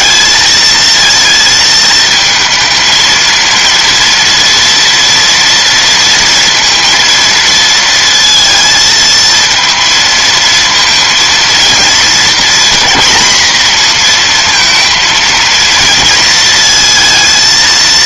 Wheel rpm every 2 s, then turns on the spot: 220, 220, 230, 230, 230, 230, 240, 230, 230.
none